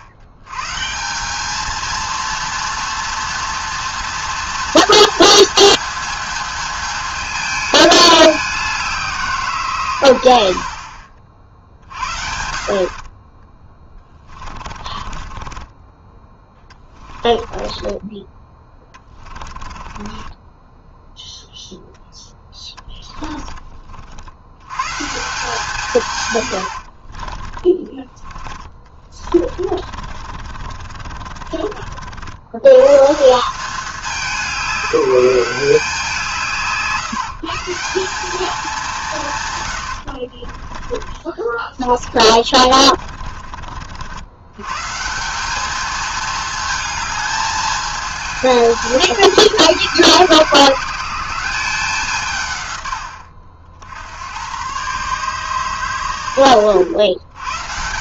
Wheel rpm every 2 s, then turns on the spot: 110, 230, 230, 220, 190, 60, 60, 20, 20, 20, 10, 10, 100, 110, 20, 50, 100, 190, 150, 200, 30, 40, 120, 220, 210, 170, 120, 110, 100.
14-24 26-32 40-44